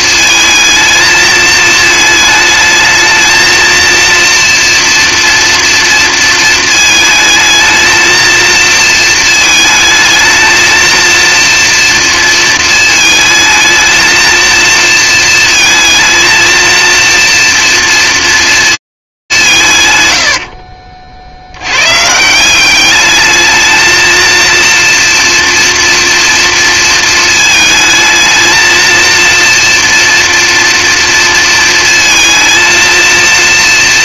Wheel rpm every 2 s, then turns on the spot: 230, 220, 230, 230, 220, 220, 230, 220, 230, 230, 60, 180, 230, 230, 230, 230, 220.
20-22